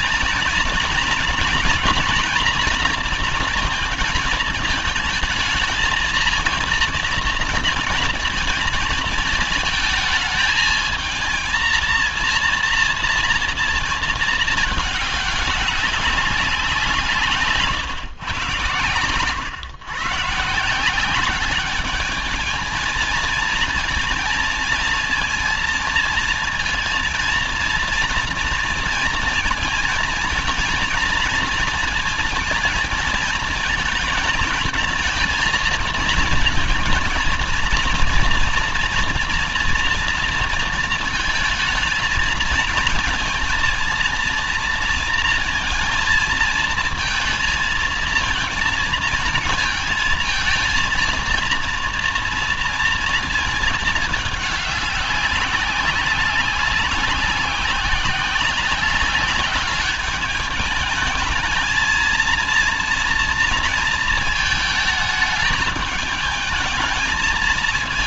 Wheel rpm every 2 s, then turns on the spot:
230, 240, 220, 230, 230, 220, 230, 210, 150, 130, 190, 220, 220, 230, 230, 230, 230, 230, 230, 230, 230, 220, 230, 230, 220, 230, 230, 200, 190, 190, 220, 230, 210, 220.
none